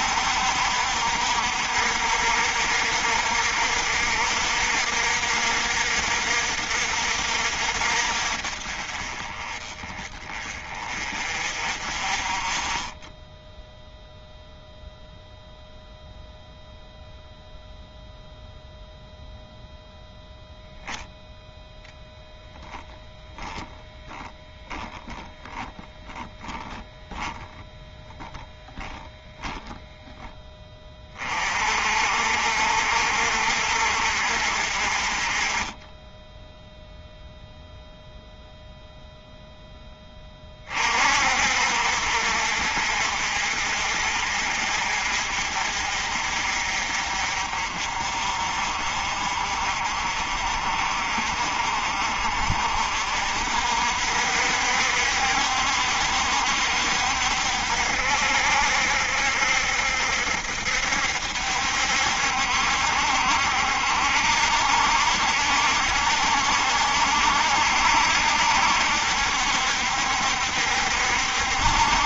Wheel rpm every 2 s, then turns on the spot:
60, 60, 60, 60, 40, 30, 20, 0, 0, 0, 0, 10, 10, 10, 10, 20, 60, 40, 0, 0, 40, 60, 50, 50, 50, 40, 50, 60, 60, 70, 70, 70, 70, 70, 60, 70.
24-26 28-30